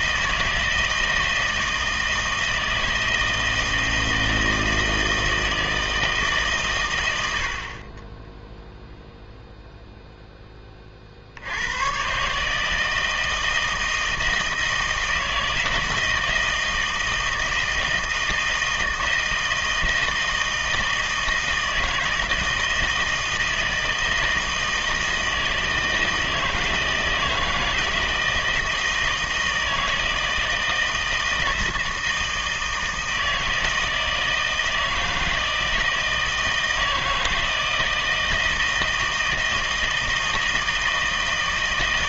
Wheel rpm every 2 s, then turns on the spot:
160, 160, 160, 130, 0, 20, 150, 160, 160, 160, 160, 160, 160, 160, 160, 160, 160, 160, 160, 160, 160.
none